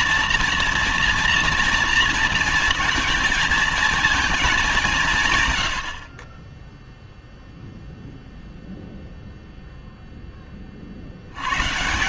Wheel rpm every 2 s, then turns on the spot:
230, 220, 210, 20, 0, 20.
none